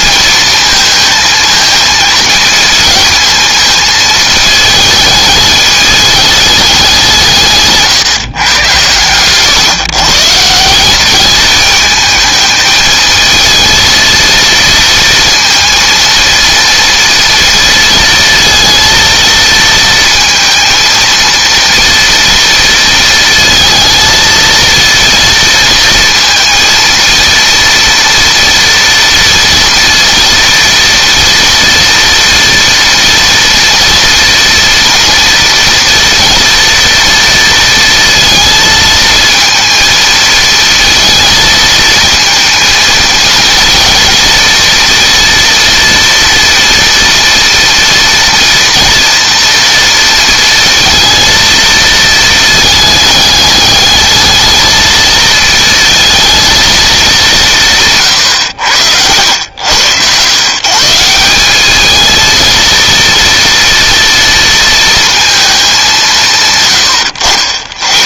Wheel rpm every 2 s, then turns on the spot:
220, 220, 220, 190, 120, 180, 220, 230, 230, 230, 230, 230, 230, 230, 230, 230, 230, 230, 240, 230, 230, 230, 230, 230, 230, 230, 220, 220, 220, 80, 150, 230, 230, 140.
none